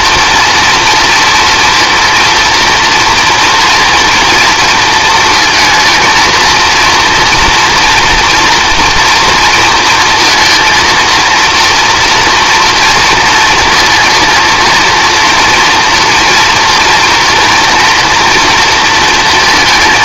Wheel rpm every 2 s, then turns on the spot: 230, 230, 230, 230, 230, 230, 230, 230, 240, 230.
none